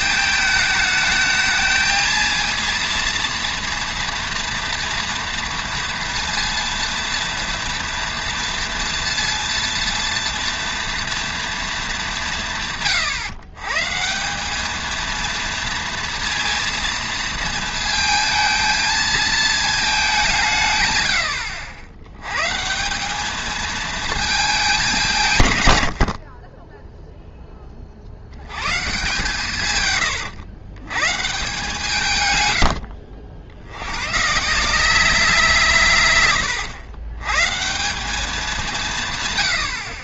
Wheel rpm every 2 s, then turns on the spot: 220, 230, 240, 230, 230, 230, 150, 210, 230, 220, 140, 160, 210, 20, 110, 110, 90, 170, 110, 190.
32-34